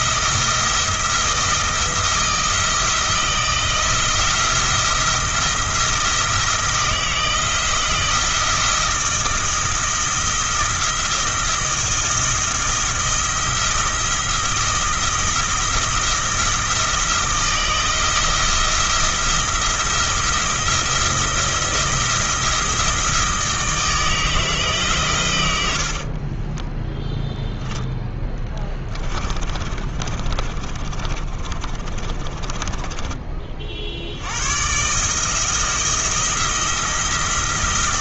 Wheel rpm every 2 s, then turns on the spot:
170, 170, 170, 170, 170, 170, 170, 170, 170, 170, 170, 170, 150, 10, 20, 30, 20, 130, 170.
26-34